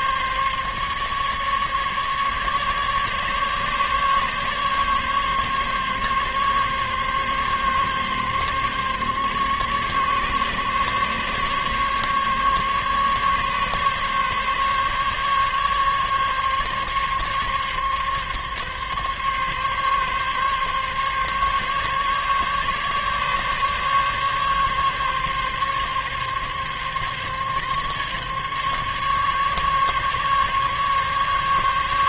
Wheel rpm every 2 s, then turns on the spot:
140, 140, 140, 140, 140, 140, 140, 140, 140, 140, 140, 140, 140, 140, 140, 140.
none